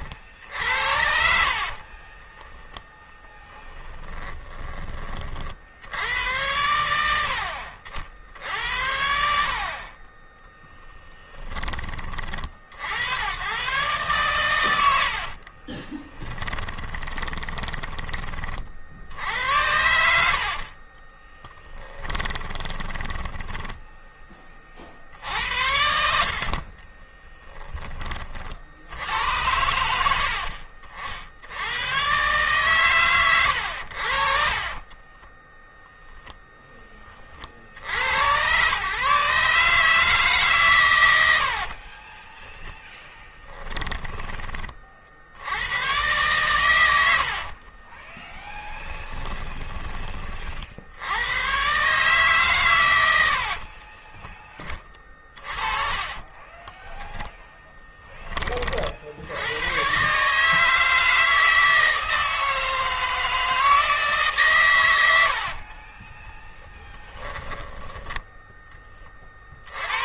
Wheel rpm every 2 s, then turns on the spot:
60, 20, 40, 80, 70, 30, 70, 90, 20, 60, 30, 10, 60, 30, 70, 60, 120, 30, 30, 130, 100, 10, 40, 90, 10, 80, 100, 40, 20, 50, 160, 160, 100, 10, 30.
0-4 10-12 14-18 20-24 26-28 34-36 40-42 46-50 54-58 64-66